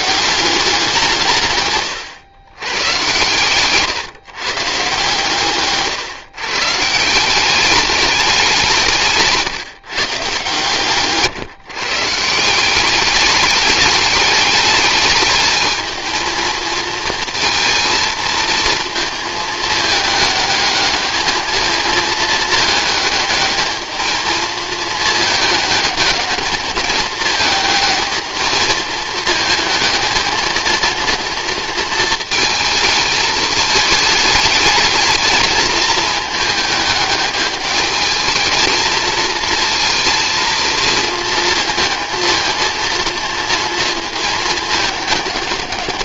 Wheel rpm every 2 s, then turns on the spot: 180, 130, 140, 160, 170, 140, 190, 210, 220, 230, 210, 210, 220, 220, 220, 230, 220, 220, 210, 220, 230, 230, 220.
none